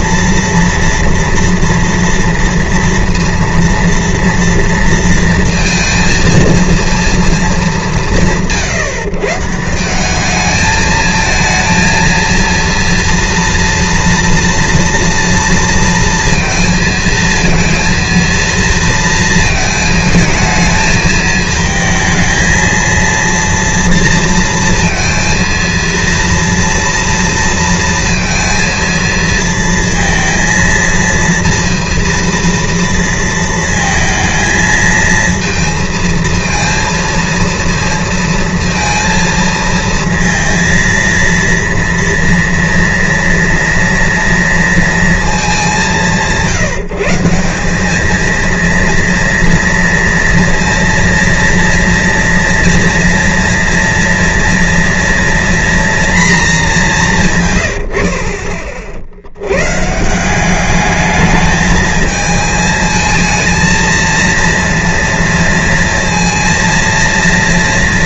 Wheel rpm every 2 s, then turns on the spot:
230, 230, 230, 210, 150, 220, 230, 230, 230, 230, 220, 230, 230, 230, 230, 230, 230, 230, 230, 230, 230, 230, 210, 180, 230, 230, 230, 240, 140, 90, 210, 220, 230, 230.
none